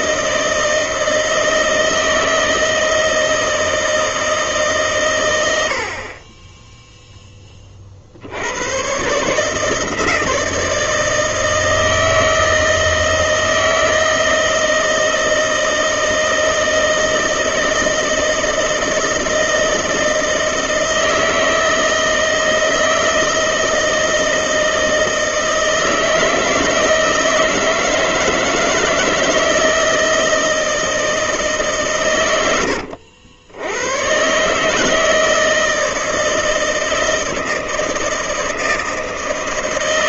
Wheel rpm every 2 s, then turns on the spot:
160, 160, 150, 10, 110, 160, 160, 160, 160, 160, 160, 160, 160, 160, 160, 160, 90, 150, 160, 160.
none